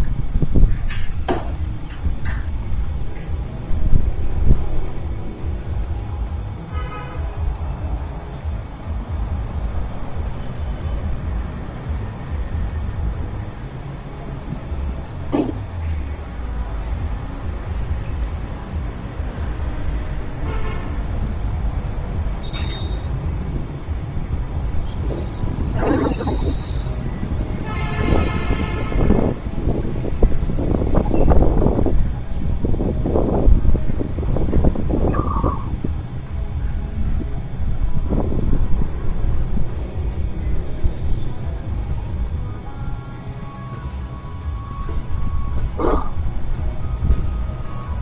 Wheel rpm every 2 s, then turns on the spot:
0, 0, 0, 0, 0, 0, 0, 0, 0, 0, 0, 0, 0, 0, 0, 0, 0, 0, 0, 0, 0, 0, 0, 0.
none